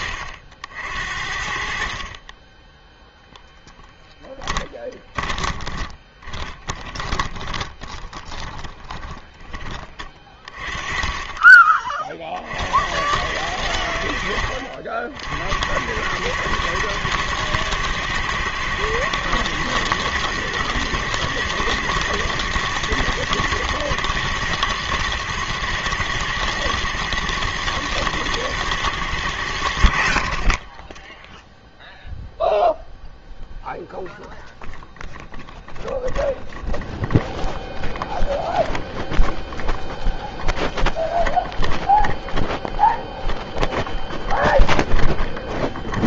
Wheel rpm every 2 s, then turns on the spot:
70, 20, 20, 20, 20, 30, 60, 70, 110, 110, 110, 110, 120, 110, 110, 30, 0, 0, 0, 0, 0, 0, 0.
4-10